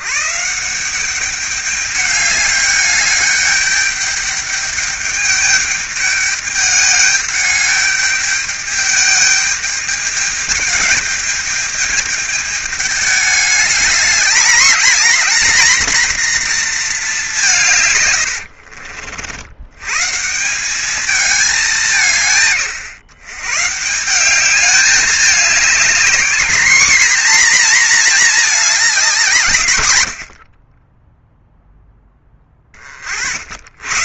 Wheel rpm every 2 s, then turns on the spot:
180, 210, 210, 210, 210, 210, 210, 220, 220, 50, 200, 140, 210, 230, 210, 20, 40.
18-20 30-32